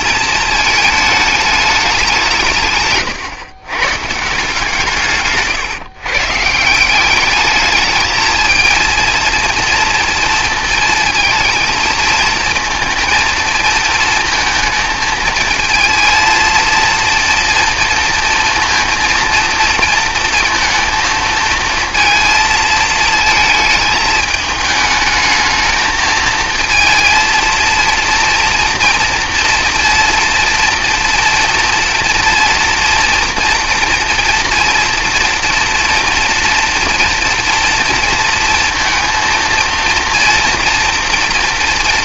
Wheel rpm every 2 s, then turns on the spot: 220, 140, 160, 160, 230, 230, 230, 230, 230, 230, 220, 220, 210, 220, 230, 230, 230, 240, 240, 230, 230.
none